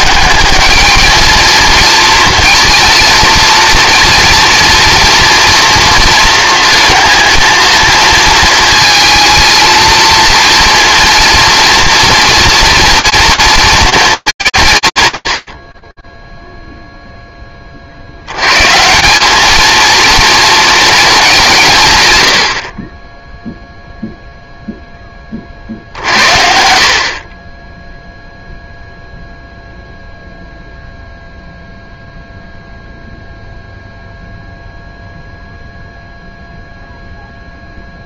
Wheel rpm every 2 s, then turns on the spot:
210, 230, 230, 230, 230, 230, 230, 130, 0, 150, 230, 40, 20, 40, 0, 0, 0, 0, 0.
none